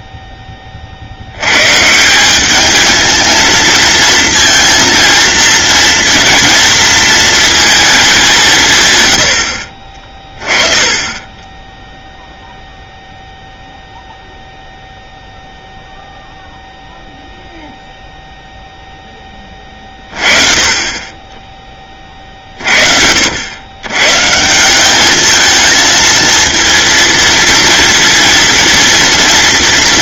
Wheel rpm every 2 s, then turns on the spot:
40, 220, 230, 230, 130, 20, 0, 0, 0, 0, 30, 50, 190, 230, 230.
none